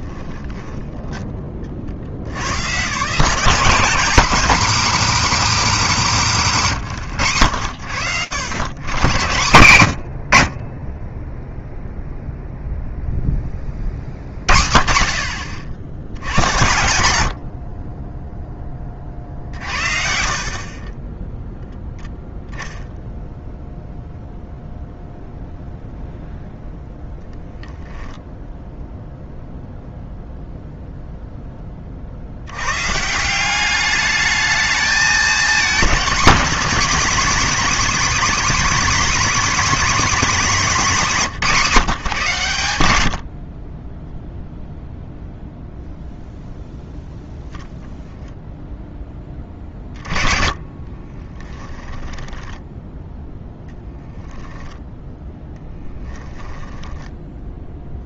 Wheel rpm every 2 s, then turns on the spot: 10, 150, 280, 100, 150, 0, 10, 60, 70, 50, 10, 0, 0, 0, 0, 10, 180, 230, 280, 300, 190, 50, 0, 0, 10, 30, 10, 10, 10.
18-20 50-52 54-58